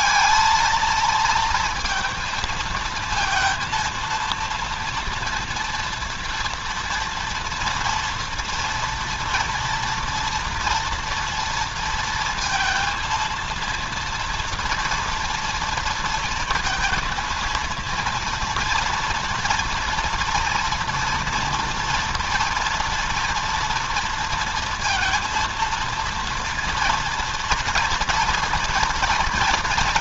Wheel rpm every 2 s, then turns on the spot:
220, 230, 230, 230, 230, 230, 230, 230, 230, 230, 230, 230, 230, 230, 230.
none